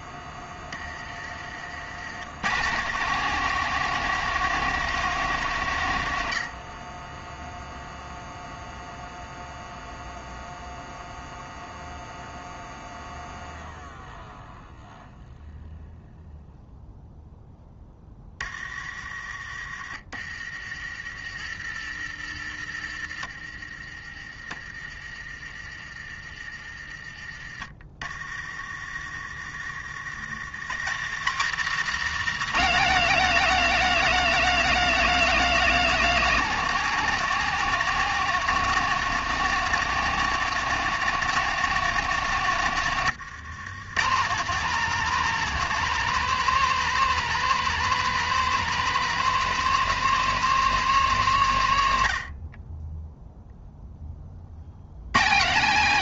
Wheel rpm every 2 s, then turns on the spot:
30, 120, 170, 50, 0, 0, 0, 0, 0, 30, 50, 50, 40, 30, 40, 100, 230, 260, 230, 220, 220, 160, 200, 240, 240, 240, 30, 60.
none